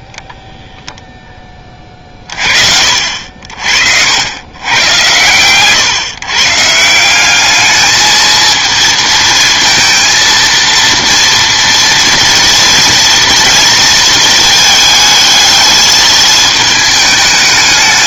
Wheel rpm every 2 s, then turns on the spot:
10, 40, 110, 150, 220, 230, 230, 220, 220.
none